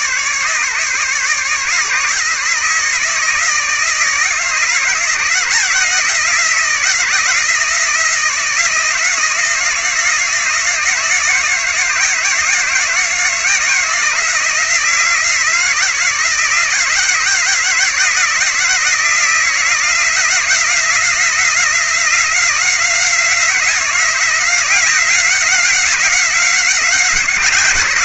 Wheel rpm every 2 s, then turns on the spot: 150, 150, 160, 170, 170, 170, 160, 160, 170, 170, 170, 180, 180, 190.
none